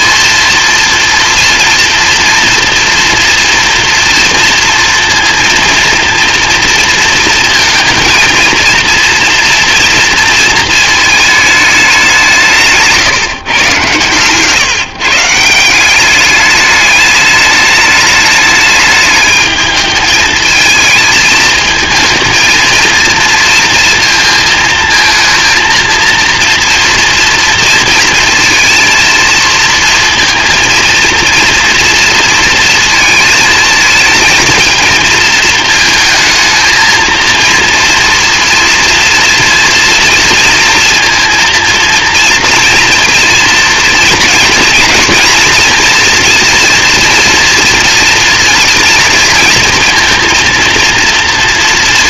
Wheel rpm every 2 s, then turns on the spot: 230, 230, 230, 230, 230, 230, 160, 150, 210, 210, 220, 230, 220, 230, 230, 230, 230, 230, 230, 230, 230, 230, 230, 230, 240, 230.
none